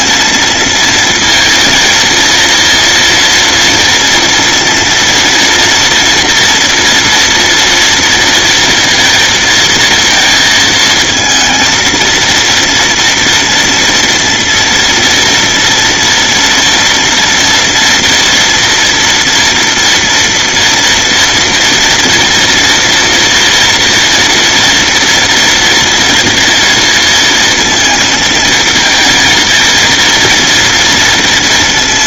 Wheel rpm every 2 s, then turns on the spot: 230, 230, 230, 230, 230, 220, 230, 230, 230, 240, 230, 230, 230, 230, 220, 230.
none